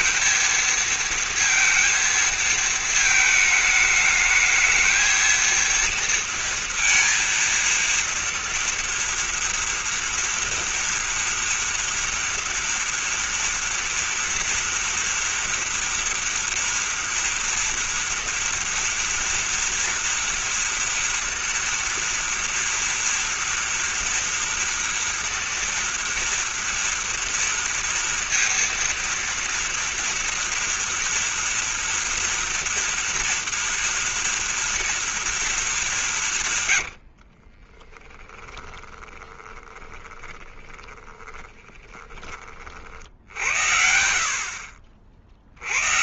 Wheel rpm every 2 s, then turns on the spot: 220, 230, 220, 230, 230, 240, 230, 230, 230, 230, 230, 240, 240, 230, 230, 230, 230, 230, 120, 10, 20, 50, 60.
36-42